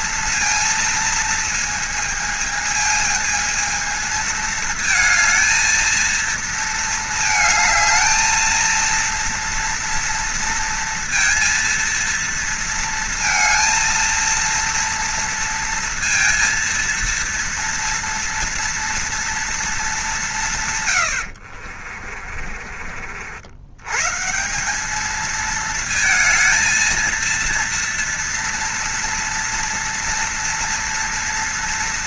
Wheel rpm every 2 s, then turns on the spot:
230, 220, 220, 230, 230, 230, 230, 230, 230, 230, 150, 40, 180, 220, 230, 230.
22-24